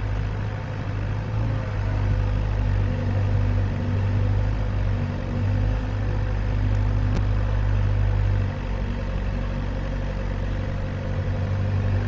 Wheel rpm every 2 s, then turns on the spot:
0, 0, 0, 0, 0, 0.
none